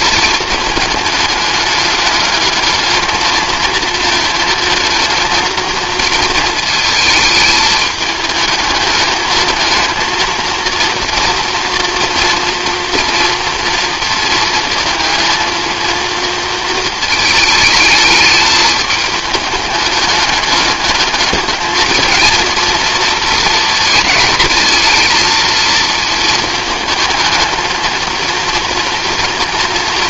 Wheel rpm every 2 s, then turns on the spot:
220, 210, 230, 230, 210, 230, 230, 220, 230, 210, 210, 230, 220, 220, 230.
none